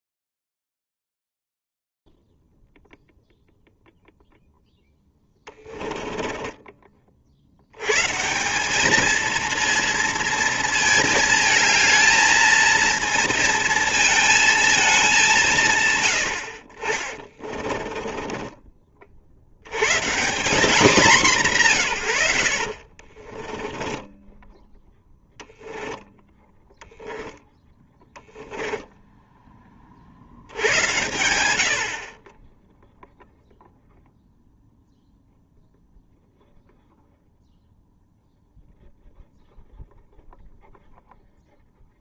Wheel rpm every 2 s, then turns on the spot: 0, 0, 0, 20, 180, 220, 220, 230, 90, 30, 190, 70, 10, 20, 0, 90, 0, 0, 0, 0, 0.
6-8 18-20 22-24 26-28